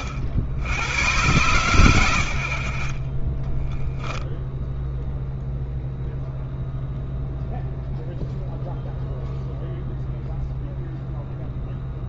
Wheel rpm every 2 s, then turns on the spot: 90, 60, 0, 0, 0, 0.
none